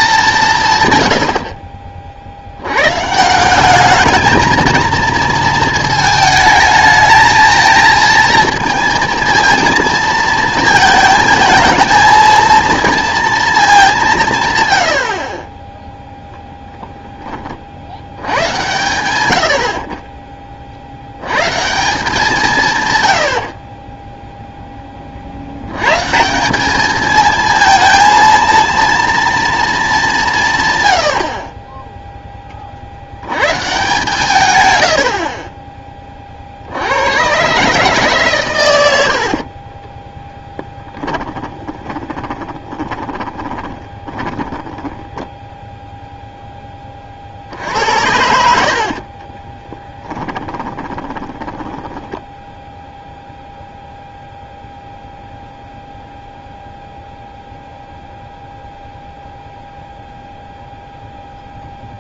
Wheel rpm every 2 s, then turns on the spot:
140, 110, 220, 220, 230, 230, 230, 100, 0, 100, 60, 130, 20, 210, 230, 130, 50, 100, 80, 100, 10, 20, 10, 20, 60, 20, 0, 0, 0, 0, 0.
40-46 48-52